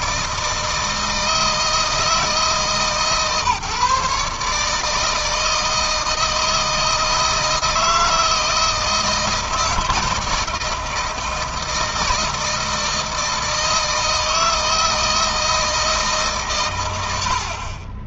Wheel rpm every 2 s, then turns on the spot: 160, 150, 150, 160, 160, 160, 160, 160, 110.
none